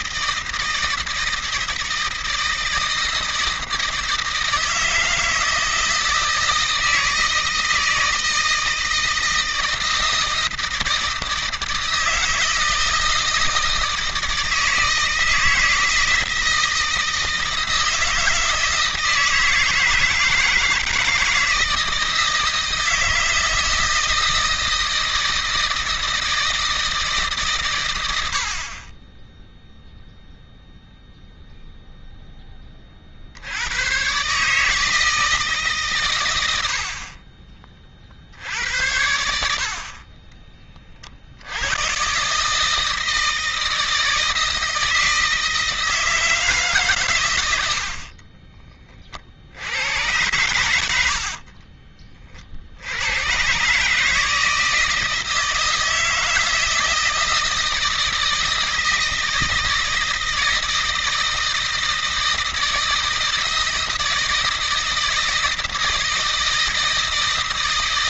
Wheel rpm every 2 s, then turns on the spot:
160, 160, 160, 160, 160, 160, 160, 160, 160, 160, 160, 160, 160, 160, 30, 0, 30, 150, 70, 80, 40, 160, 160, 140, 30, 90, 70, 160, 160, 160, 160, 160, 160, 160.
50-52